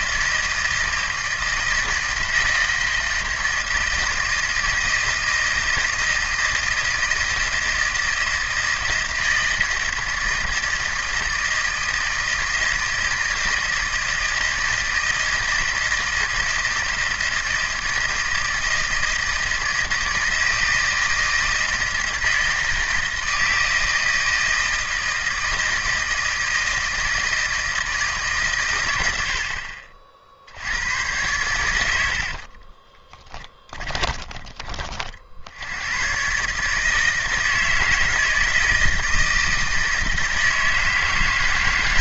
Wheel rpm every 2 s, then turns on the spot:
160, 160, 160, 160, 160, 160, 160, 160, 160, 160, 160, 160, 160, 160, 120, 80, 40, 30, 140, 160, 160.
32-34